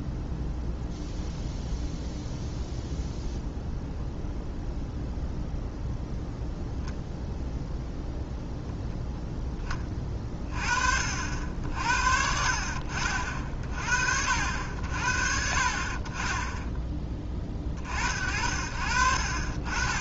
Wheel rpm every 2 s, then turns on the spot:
0, 0, 0, 0, 0, 50, 50, 60, 10, 60.
none